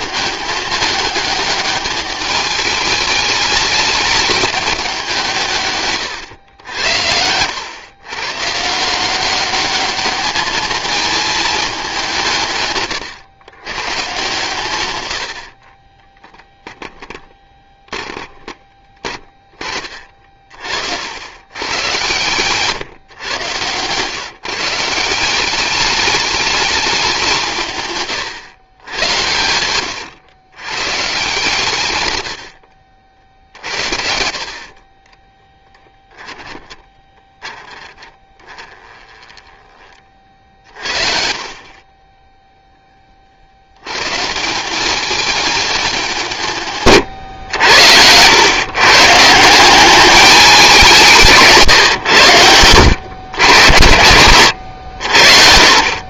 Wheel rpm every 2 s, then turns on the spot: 210, 210, 190, 90, 170, 220, 130, 100, 10, 20, 60, 140, 160, 190, 110, 140, 60, 30, 10, 20, 50, 20, 200, 130, 140, 190, 90, 70.
16-18 36-40